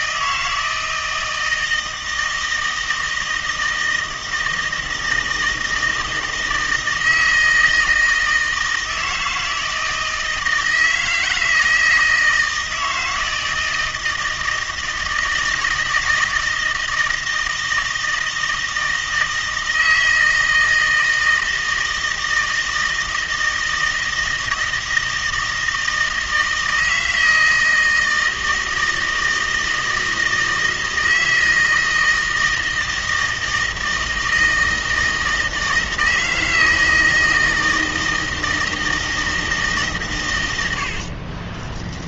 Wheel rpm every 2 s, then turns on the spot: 160, 160, 160, 160, 160, 160, 160, 160, 160, 160, 160, 160, 160, 160, 160, 160, 160, 160, 160, 160, 70.
40-42